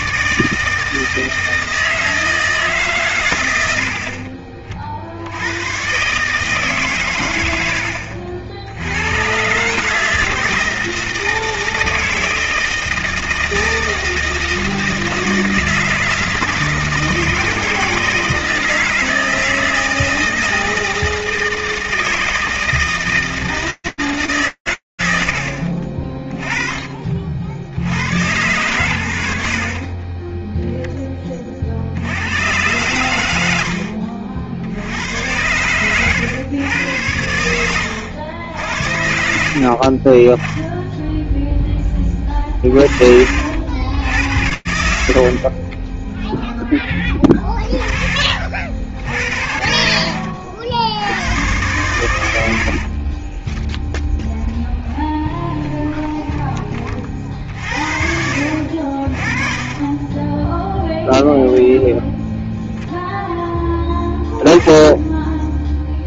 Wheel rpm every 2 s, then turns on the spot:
150, 150, 50, 140, 80, 160, 160, 160, 160, 160, 160, 160, 140, 20, 110, 10, 100, 70, 120, 90, 10, 40, 110, 0, 50, 70, 80, 0, 20, 60, 0, 0, 10.
42-44